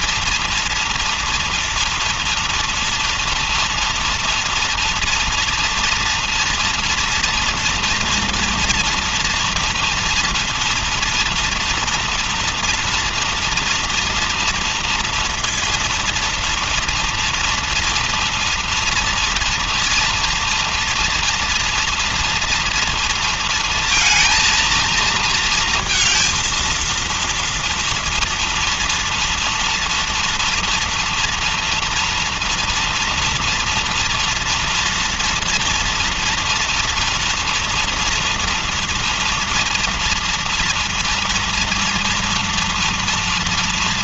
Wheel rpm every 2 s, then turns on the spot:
230, 240, 230, 240, 230, 230, 230, 230, 230, 230, 230, 230, 230, 230, 230, 240, 230, 230, 230, 230, 230, 230.
none